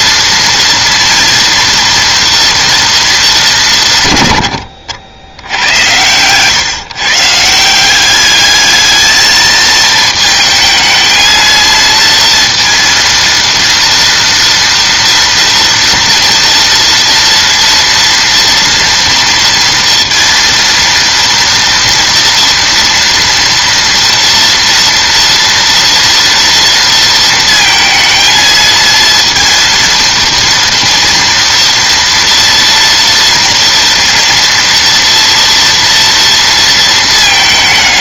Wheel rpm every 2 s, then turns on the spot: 230, 230, 80, 140, 220, 220, 230, 230, 230, 230, 230, 240, 230, 230, 220, 230, 230, 230, 230.
none